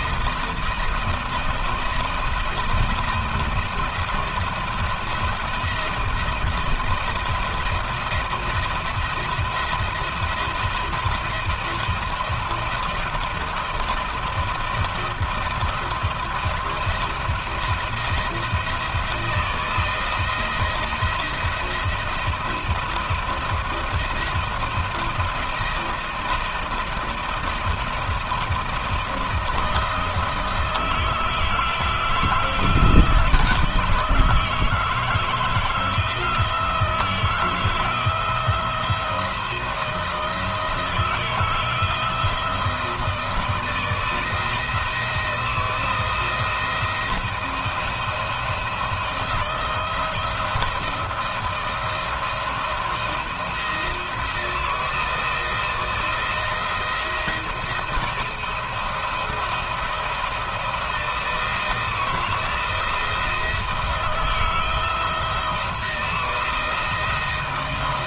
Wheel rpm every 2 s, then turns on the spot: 170, 170, 170, 170, 170, 170, 170, 170, 170, 170, 170, 170, 170, 170, 160, 160, 160, 160, 160, 170, 170, 170, 160, 170, 170, 170, 170, 160, 170, 160, 170, 160, 160, 160.
none